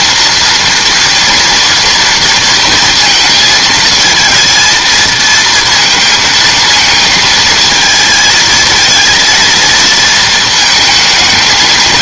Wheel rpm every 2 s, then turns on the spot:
230, 230, 230, 220, 220, 220.
none